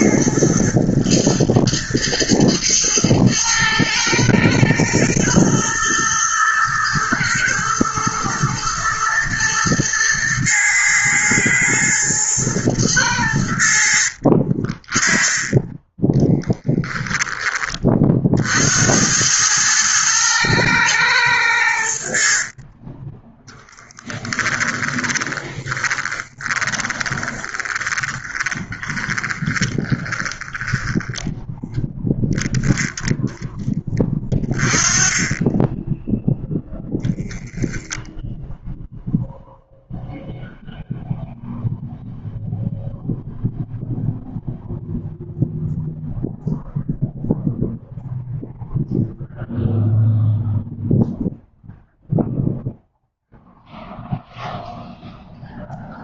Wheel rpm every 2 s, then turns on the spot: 120, 110, 110, 110, 110, 110, 110, 30, 10, 90, 110, 20, 20, 20, 30, 20, 0, 20, 0, 0, 0, 0, 0, 0, 0, 0, 0, 0.
22-32